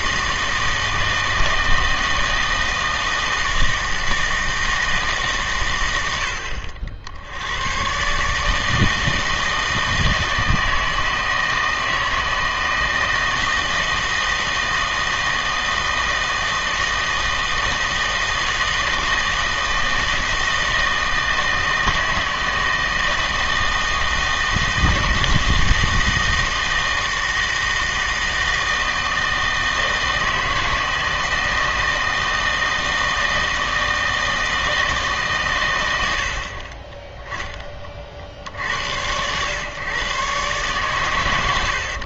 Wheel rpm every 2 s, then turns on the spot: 160, 160, 160, 60, 150, 160, 160, 160, 160, 160, 160, 160, 160, 160, 160, 160, 160, 160, 30, 80, 120.
none